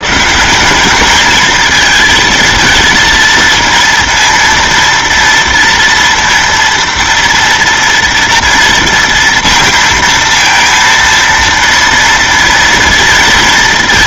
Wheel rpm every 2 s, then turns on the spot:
190, 230, 230, 230, 230, 230, 230.
none